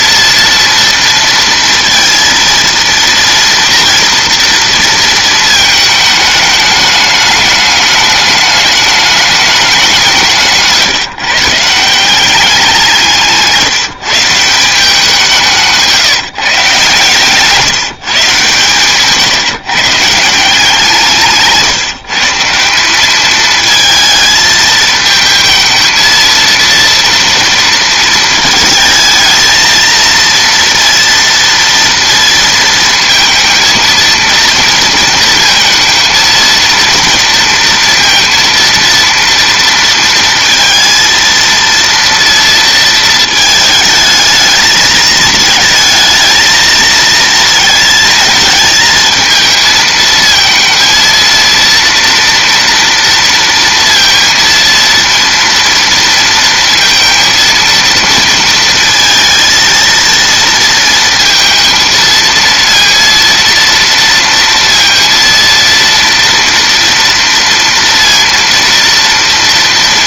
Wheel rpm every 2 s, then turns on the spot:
230, 230, 230, 210, 210, 160, 170, 180, 150, 140, 160, 200, 220, 230, 220, 230, 230, 230, 230, 230, 230, 230, 220, 220, 220, 230, 230, 230, 230, 230, 230, 230, 230, 230, 230.
none